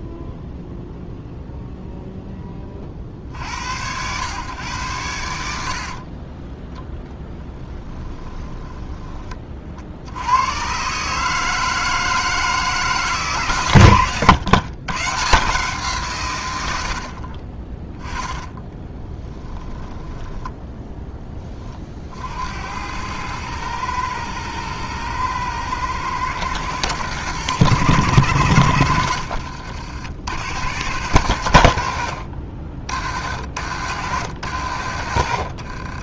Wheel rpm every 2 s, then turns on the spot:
20, 110, 10, 20, 90, 160, 130, 110, 10, 20, 40, 110, 120, 100, 60, 90, 80, 60.
6-8 18-20 34-36